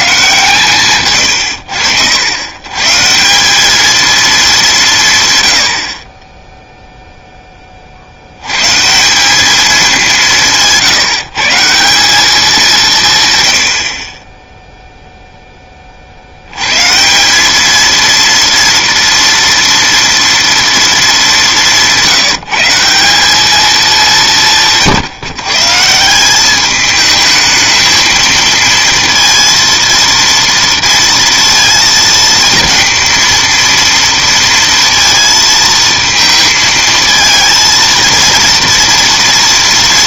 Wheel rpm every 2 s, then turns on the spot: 130, 130, 180, 0, 140, 170, 170, 0, 130, 230, 230, 180, 170, 210, 230, 230, 230, 230, 220, 240.
none